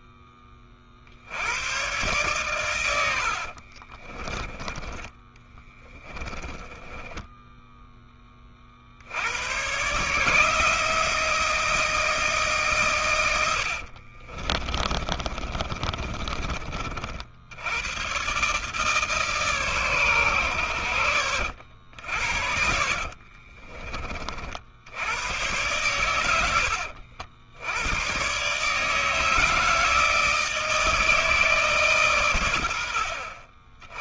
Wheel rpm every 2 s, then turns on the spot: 30, 120, 20, 10, 40, 160, 150, 30, 40, 140, 100, 40, 60, 90, 140, 160, 90.
4-8 14-16 22-24